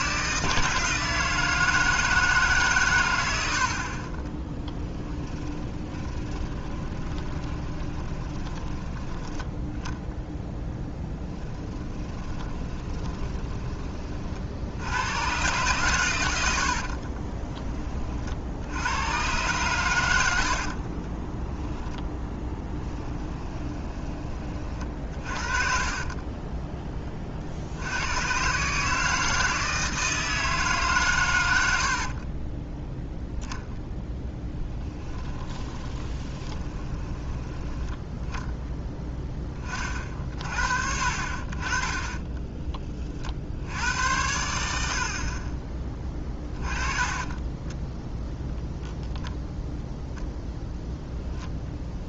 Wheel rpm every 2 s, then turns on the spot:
160, 120, 10, 20, 10, 10, 20, 90, 60, 80, 50, 10, 40, 20, 150, 140, 10, 10, 20, 10, 50, 20, 60, 30, 0, 10.
4-8 10-14 16-18 20-26 32-38